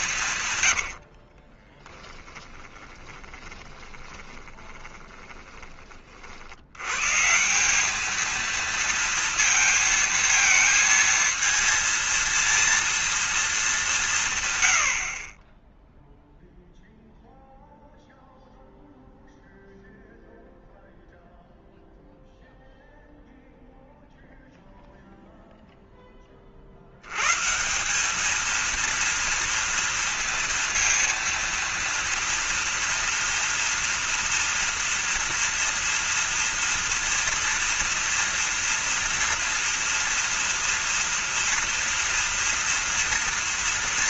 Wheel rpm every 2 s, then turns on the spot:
100, 20, 20, 100, 230, 230, 230, 90, 0, 0, 0, 0, 0, 70, 230, 230, 230, 230, 230, 230, 230, 230.
0-6